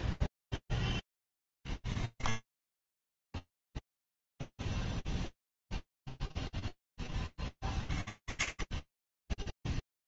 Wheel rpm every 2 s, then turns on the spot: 0, 10, 0, 0, 20.
none